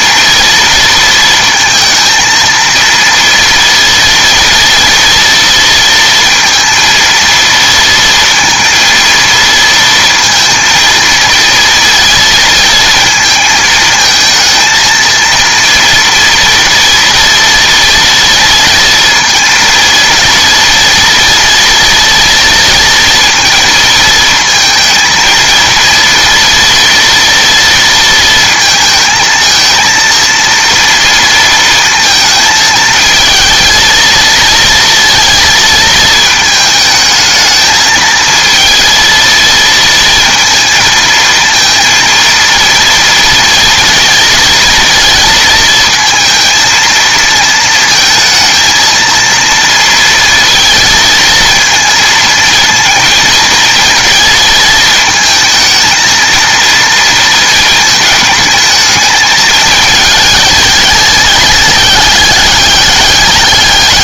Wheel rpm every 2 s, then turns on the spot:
230, 230, 230, 230, 230, 230, 220, 220, 230, 230, 230, 230, 220, 230, 220, 230, 220, 230, 220, 220, 230, 230, 230, 230, 220, 230, 230, 220, 230, 220, 210, 210.
none